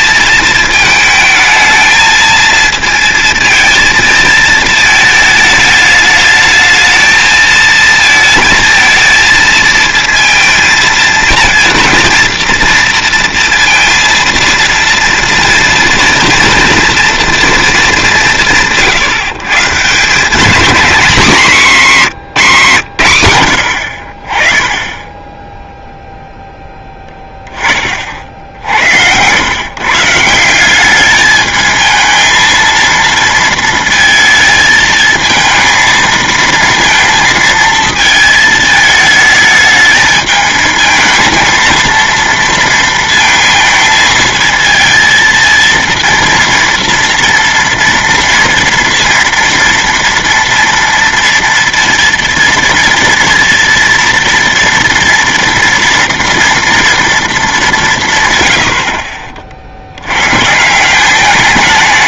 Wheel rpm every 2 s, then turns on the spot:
220, 230, 220, 220, 220, 230, 230, 230, 230, 120, 210, 170, 20, 10, 80, 190, 230, 220, 230, 220, 220, 230, 220, 230, 230, 230, 230, 230, 230, 100, 150.
none